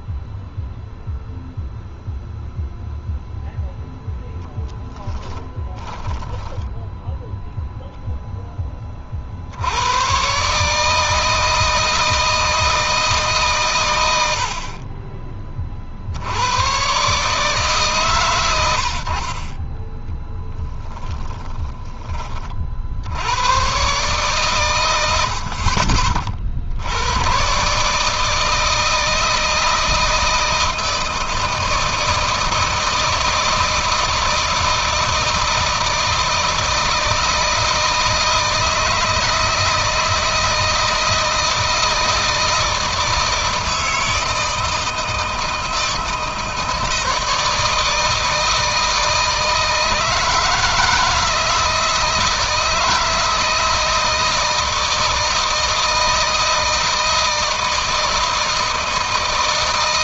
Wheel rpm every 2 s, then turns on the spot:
0, 0, 20, 10, 30, 160, 160, 30, 130, 70, 10, 70, 100, 90, 160, 160, 160, 160, 160, 160, 160, 160, 160, 160, 160, 160, 160, 160, 160, 160.
4-6 20-22